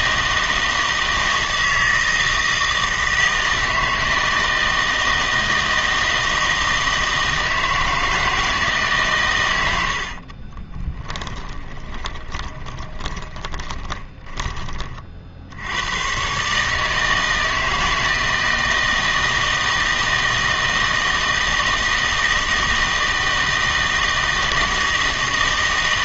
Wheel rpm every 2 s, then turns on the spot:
160, 160, 160, 160, 150, 30, 20, 20, 150, 160, 160, 160, 160.
10-14